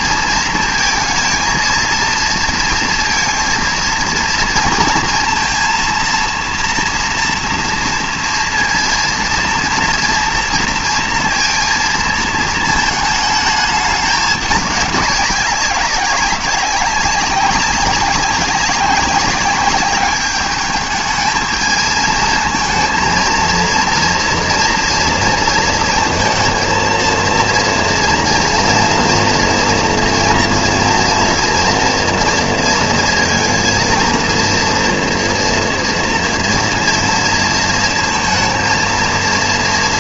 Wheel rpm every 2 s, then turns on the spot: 230, 230, 230, 230, 230, 230, 220, 200, 200, 200, 210, 220, 240, 230, 240, 230, 230, 230, 230, 230.
none